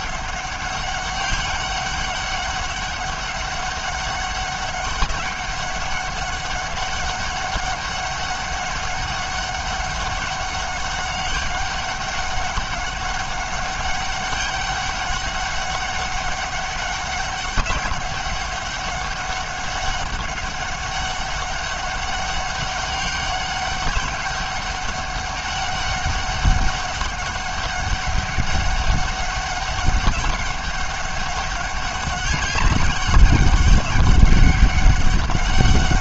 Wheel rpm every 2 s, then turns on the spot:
200, 200, 200, 200, 200, 200, 200, 200, 200, 200, 200, 190, 200, 200, 200, 200, 200, 200.
none